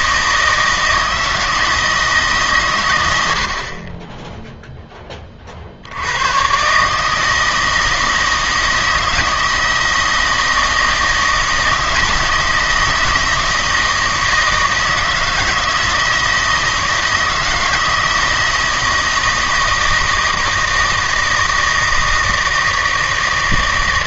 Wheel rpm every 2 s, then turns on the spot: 160, 120, 0, 130, 160, 160, 160, 160, 160, 160, 160, 160.
none